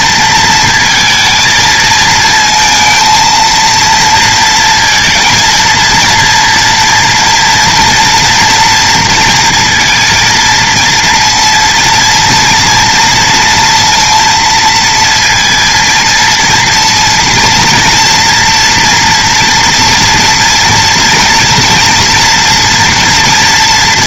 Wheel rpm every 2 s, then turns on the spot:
230, 230, 220, 230, 230, 230, 230, 230, 230, 230, 230, 230.
none